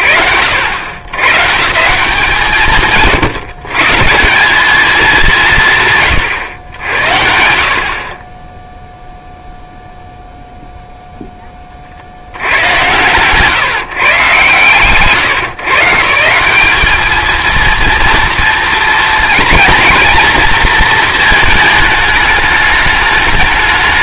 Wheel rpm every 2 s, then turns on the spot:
110, 130, 190, 70, 0, 0, 130, 110, 210, 230, 230, 200.
none